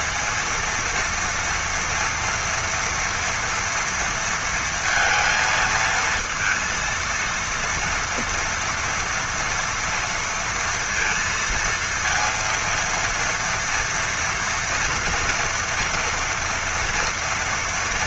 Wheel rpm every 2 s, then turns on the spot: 230, 230, 230, 230, 230, 230, 230, 240, 230.
none